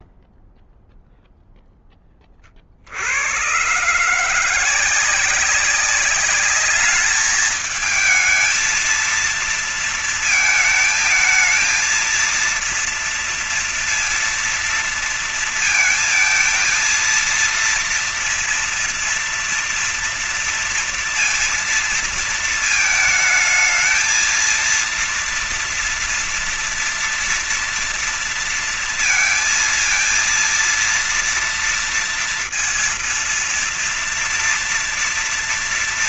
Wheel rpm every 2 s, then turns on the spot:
0, 30, 160, 200, 220, 230, 230, 230, 230, 230, 230, 220, 230, 230, 230, 230, 230, 230.
none